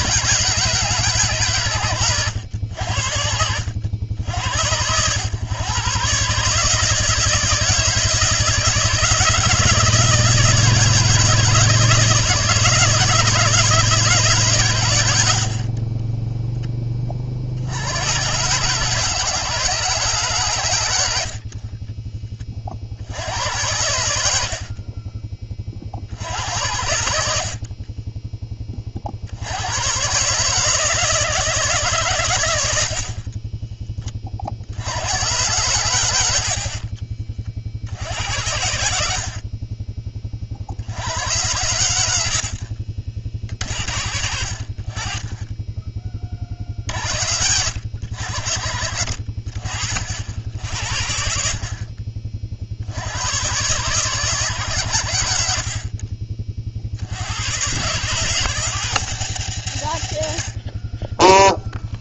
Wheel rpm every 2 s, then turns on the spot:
150, 70, 100, 160, 160, 160, 160, 100, 30, 140, 80, 60, 30, 80, 50, 160, 60, 90, 50, 70, 70, 50, 40, 60, 60, 60, 70, 100, 60, 120, 20.
24-28 32-34 36-38